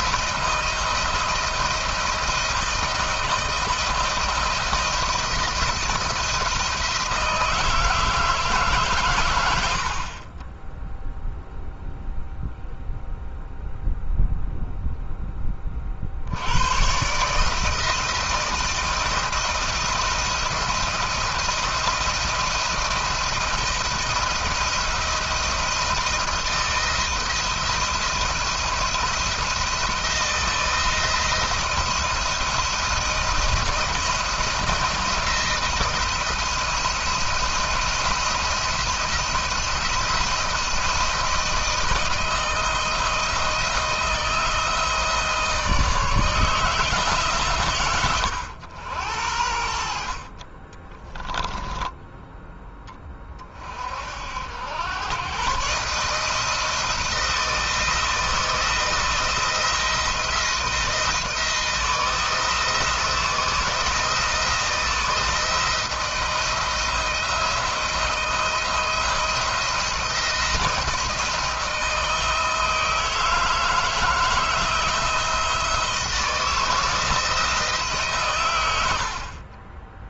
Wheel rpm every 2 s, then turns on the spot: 160, 170, 170, 170, 150, 20, 0, 0, 100, 160, 170, 170, 170, 160, 170, 160, 170, 170, 170, 170, 160, 160, 160, 160, 100, 30, 10, 90, 160, 170, 170, 160, 160, 170, 170, 170, 160, 160, 160, 100.
50-52